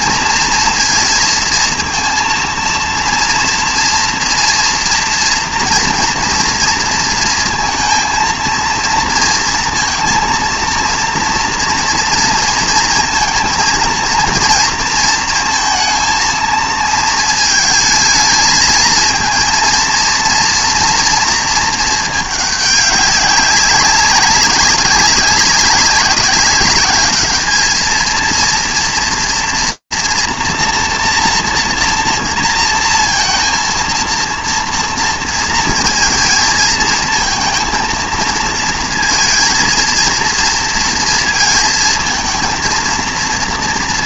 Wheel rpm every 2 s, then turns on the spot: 230, 230, 230, 230, 230, 230, 230, 230, 220, 220, 230, 210, 200, 200, 230, 240, 230, 230, 220, 230, 230, 230.
none